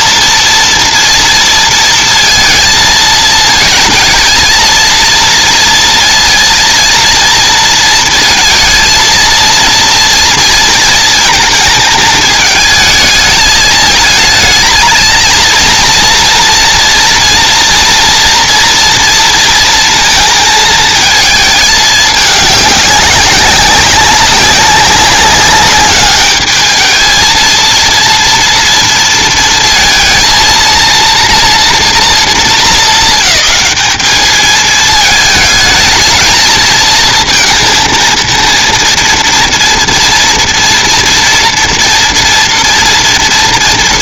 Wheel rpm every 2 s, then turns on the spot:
230, 220, 230, 230, 230, 220, 220, 230, 230, 230, 210, 190, 200, 230, 230, 240, 220, 220, 230, 230, 230, 230.
none